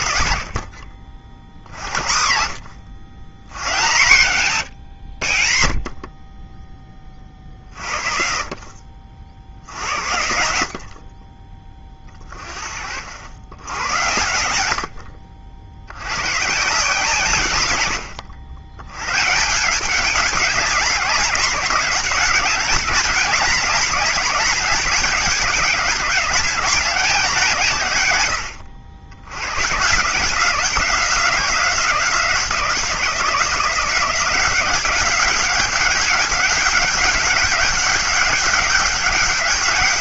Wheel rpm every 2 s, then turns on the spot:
40, 80, 130, 30, 50, 60, 40, 90, 140, 110, 190, 210, 200, 200, 80, 180, 170, 190, 200, 200.
none